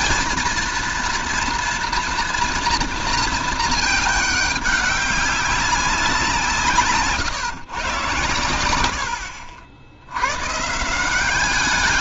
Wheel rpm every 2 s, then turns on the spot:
230, 230, 200, 170, 100, 140.
none